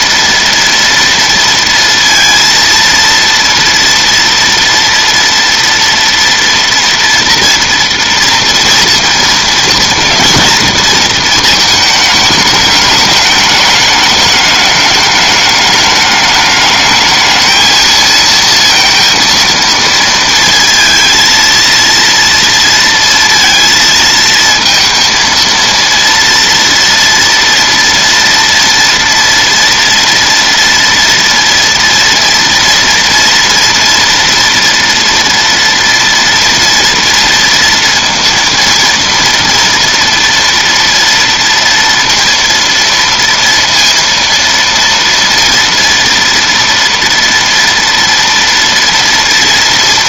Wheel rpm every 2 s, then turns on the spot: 230, 230, 230, 230, 230, 220, 210, 210, 210, 230, 230, 230, 230, 230, 230, 230, 230, 230, 230, 230, 230, 230, 230, 230, 230.
none